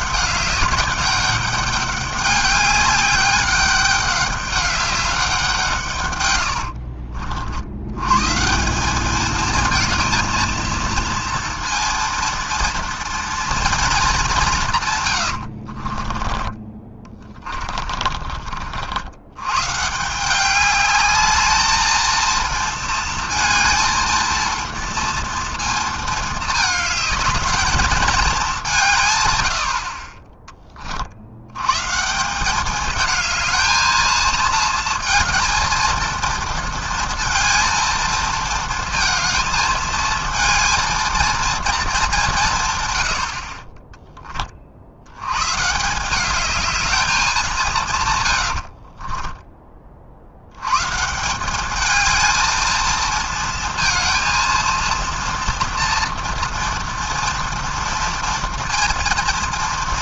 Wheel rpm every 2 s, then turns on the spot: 200, 200, 200, 70, 180, 230, 230, 160, 20, 80, 200, 230, 230, 210, 160, 30, 210, 230, 230, 230, 230, 120, 60, 210, 70, 120, 230, 230, 230, 230.
6-8 48-50